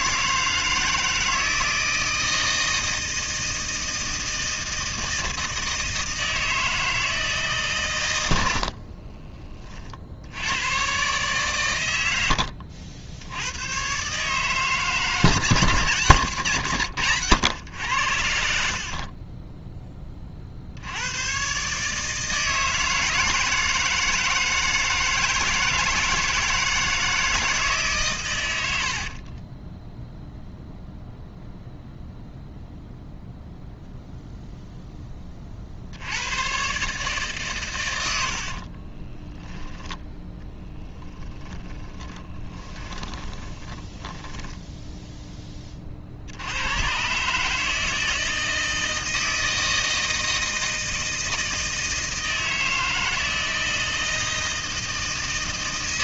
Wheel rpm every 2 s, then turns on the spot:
160, 160, 160, 160, 50, 120, 80, 150, 120, 50, 80, 160, 160, 160, 80, 0, 0, 10, 140, 40, 10, 20, 10, 110, 160, 160, 160, 160.
8-10 28-30 38-46